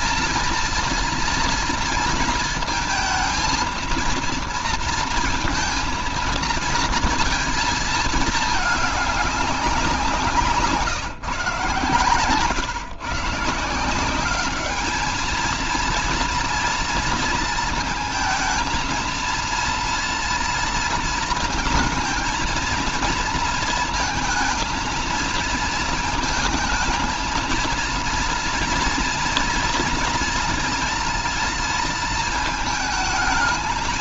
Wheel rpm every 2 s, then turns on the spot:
230, 220, 220, 230, 210, 160, 130, 210, 230, 220, 230, 230, 230, 230, 230, 230, 220.
none